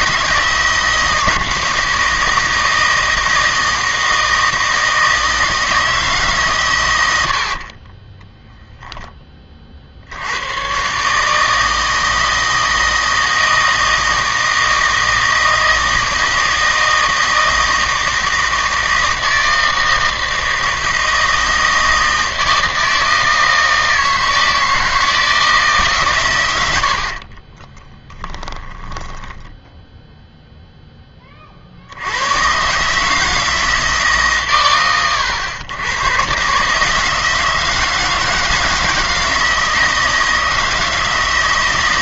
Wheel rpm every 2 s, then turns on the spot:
160, 160, 160, 110, 0, 130, 160, 160, 160, 160, 160, 160, 160, 70, 20, 10, 140, 110, 150, 160, 160.
26-30